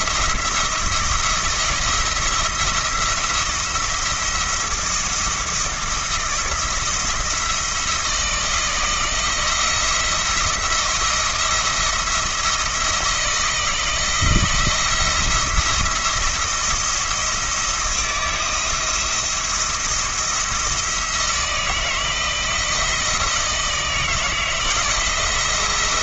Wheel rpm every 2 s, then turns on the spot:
170, 170, 170, 160, 170, 170, 170, 170, 170, 170, 160, 160, 160.
none